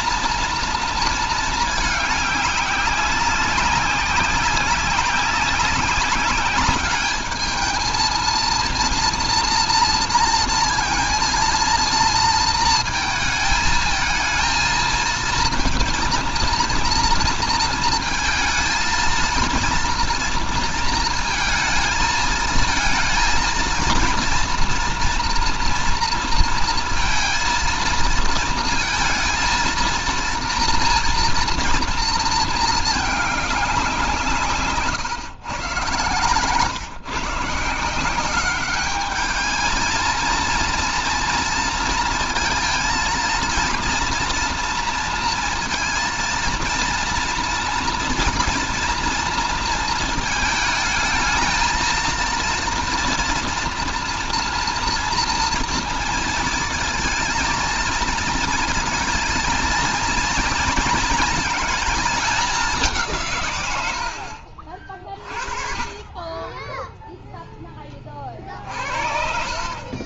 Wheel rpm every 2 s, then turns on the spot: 230, 200, 190, 200, 230, 230, 230, 220, 230, 220, 230, 220, 230, 230, 230, 230, 230, 160, 130, 200, 230, 230, 230, 230, 230, 220, 230, 230, 230, 230, 230, 210, 60, 10, 40.
34-36